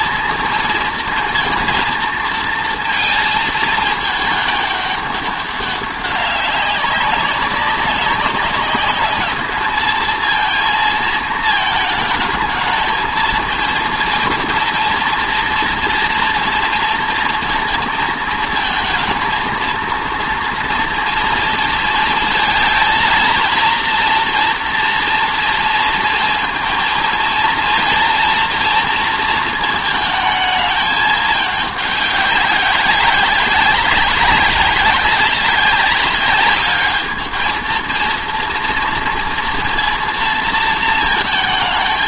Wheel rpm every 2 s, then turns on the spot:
230, 220, 210, 200, 200, 230, 220, 230, 230, 220, 230, 220, 240, 230, 240, 220, 200, 200, 200, 230, 230.
none